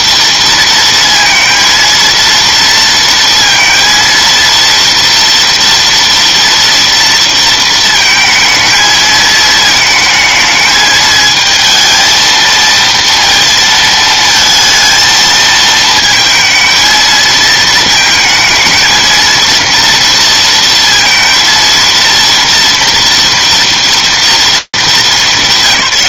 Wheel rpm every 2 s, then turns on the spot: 230, 230, 230, 230, 220, 220, 230, 220, 230, 220, 230, 230, 230.
none